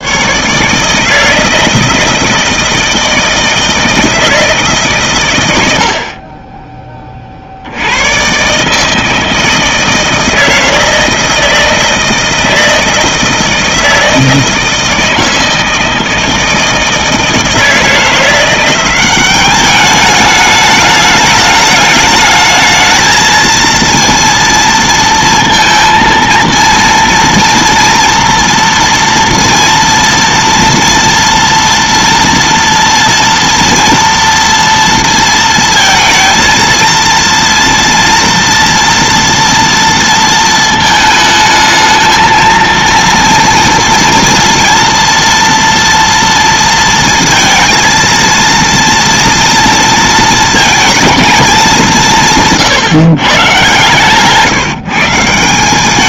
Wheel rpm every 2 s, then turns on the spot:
140, 160, 160, 20, 140, 160, 160, 160, 160, 180, 210, 220, 230, 230, 230, 230, 230, 230, 230, 230, 220, 230, 230, 230, 230, 230, 160, 150.
none